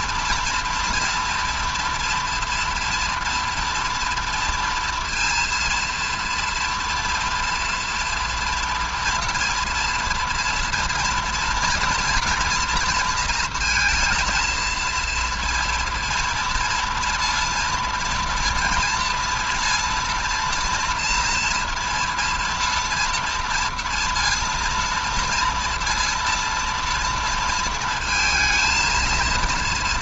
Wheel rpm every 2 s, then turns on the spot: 230, 230, 230, 230, 240, 230, 230, 230, 230, 230, 230, 230, 230, 230, 220.
none